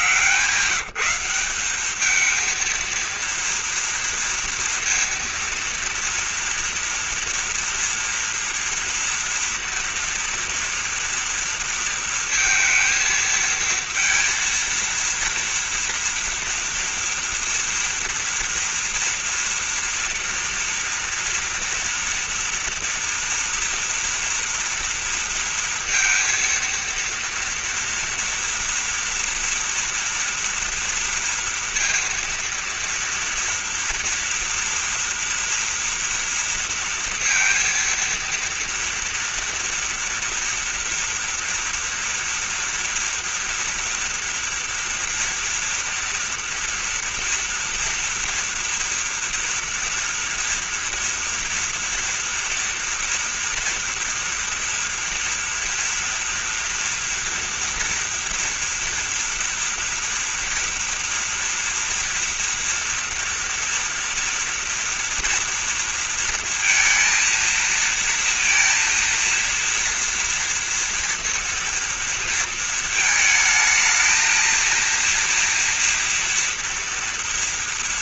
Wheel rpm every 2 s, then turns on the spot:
170, 230, 230, 230, 230, 230, 230, 230, 230, 230, 230, 230, 230, 230, 230, 230, 230, 230, 230, 230, 230, 240, 240, 230, 230, 230, 230, 230, 240, 240, 230, 230, 230, 230, 230, 230, 230, 230, 230.
none